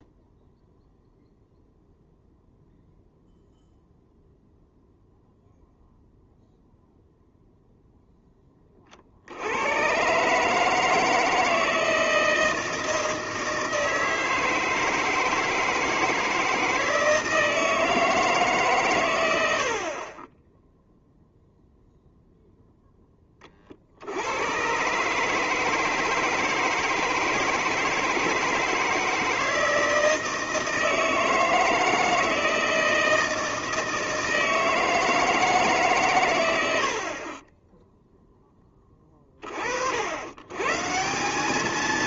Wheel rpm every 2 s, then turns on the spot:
0, 0, 0, 0, 20, 150, 160, 160, 160, 140, 10, 0, 120, 160, 160, 160, 160, 160, 90, 10, 130.
none